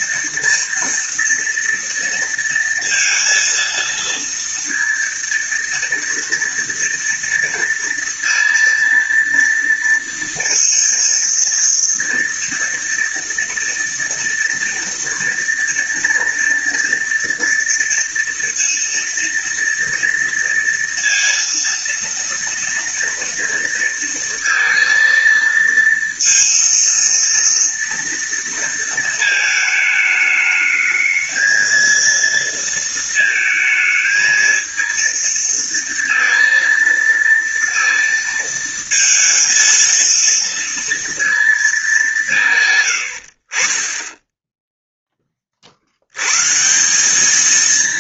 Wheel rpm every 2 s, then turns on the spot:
230, 230, 230, 230, 230, 230, 230, 230, 230, 230, 230, 230, 230, 230, 220, 220, 230, 230, 230, 230, 230, 90, 10, 190.
none